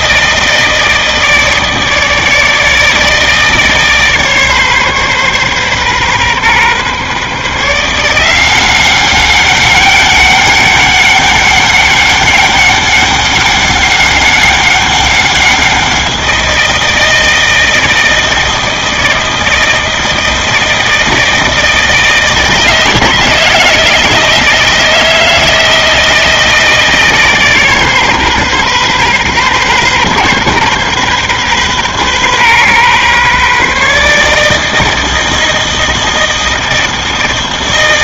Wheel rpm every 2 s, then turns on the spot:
160, 160, 140, 130, 190, 200, 200, 200, 170, 160, 160, 160, 160, 160, 130, 130, 130, 160, 160.
none